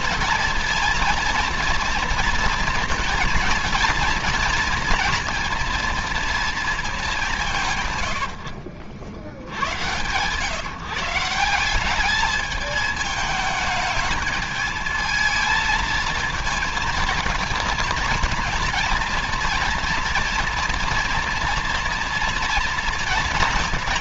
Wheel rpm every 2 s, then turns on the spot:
230, 230, 230, 220, 90, 130, 220, 220, 230, 220, 230, 240.
none